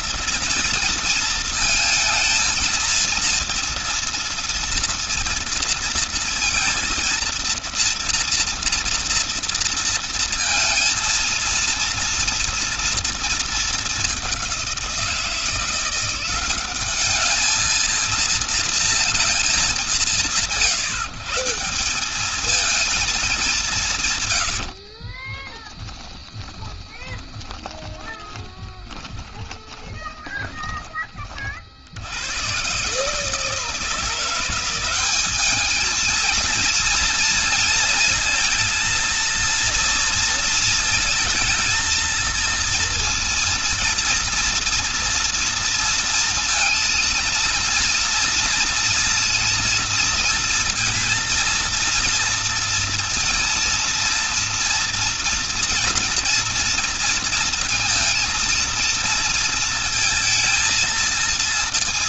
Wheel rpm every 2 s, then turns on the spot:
230, 220, 230, 230, 230, 230, 230, 190, 190, 230, 150, 220, 90, 10, 20, 20, 120, 180, 230, 230, 230, 230, 230, 230, 230, 230, 230, 230, 230, 230, 230.
24-30